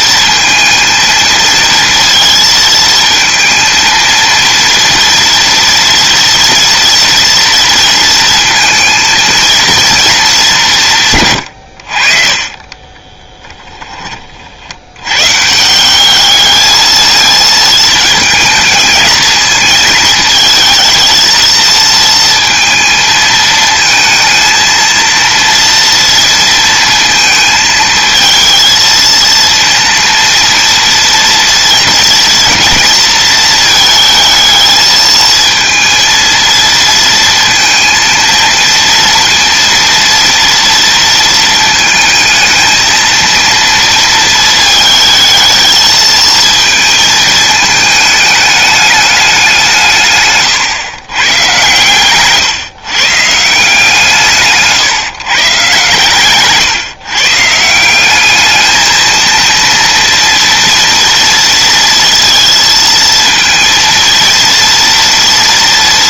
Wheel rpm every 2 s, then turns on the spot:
230, 230, 230, 230, 230, 130, 20, 110, 220, 220, 220, 220, 230, 230, 230, 230, 230, 220, 230, 230, 230, 230, 220, 220, 200, 130, 150, 140, 130, 230, 230, 230, 230.
12-14